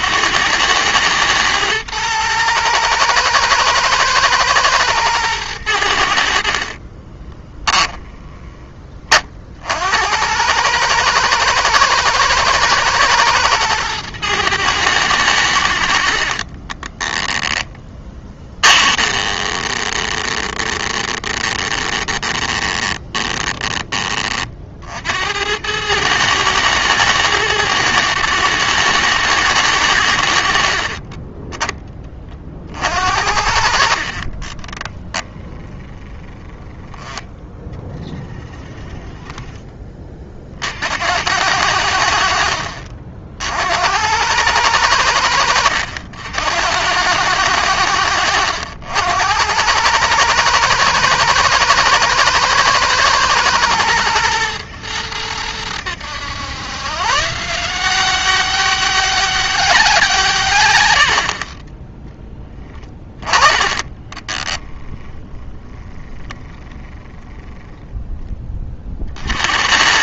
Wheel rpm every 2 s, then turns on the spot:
110, 120, 110, 40, 30, 110, 110, 110, 20, 20, 20, 20, 70, 110, 110, 40, 60, 10, 20, 30, 70, 50, 90, 90, 80, 120, 110, 110, 130, 200, 90, 20, 10, 10, 50.
6-8 16-24 30-32 34-36 62-64